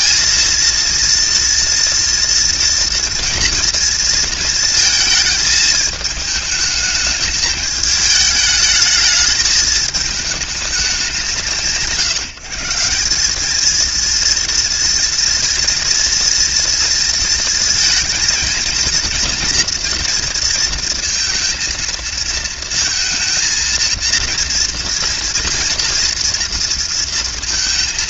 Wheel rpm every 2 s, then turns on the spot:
230, 230, 220, 210, 210, 200, 150, 230, 230, 230, 230, 220, 230, 230.
none